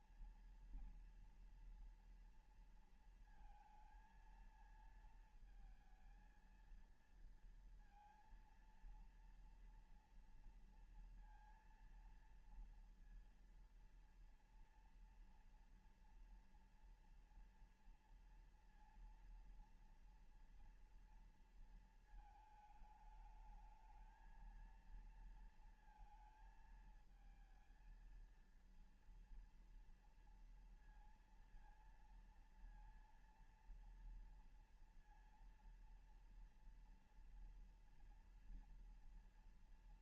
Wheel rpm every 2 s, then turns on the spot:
240, 240, 230, 230, 230, 230, 230, 230, 230, 230, 230, 220, 220, 220, 230, 230, 230, 230, 230, 230.
none